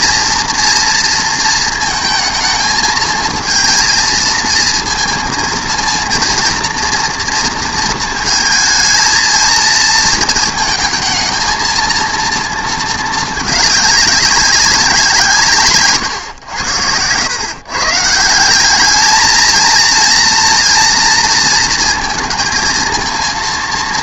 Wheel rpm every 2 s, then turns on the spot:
230, 220, 220, 230, 220, 220, 220, 190, 100, 190, 230, 220.
none